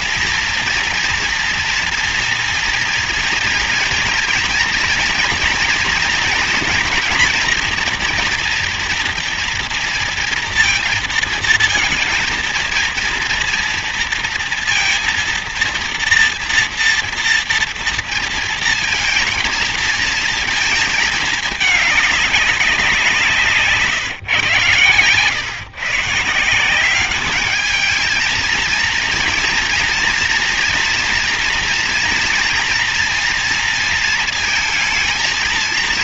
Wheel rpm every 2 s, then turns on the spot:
230, 230, 230, 240, 240, 230, 230, 230, 230, 230, 230, 190, 120, 170, 230, 230, 230, 230.
none